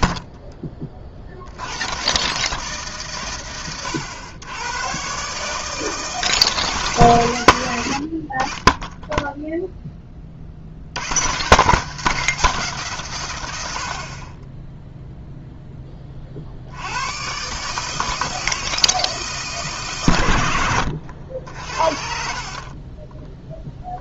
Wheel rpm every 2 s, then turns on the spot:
30, 140, 110, 150, 20, 70, 170, 20, 60, 160, 90, 40.
22-24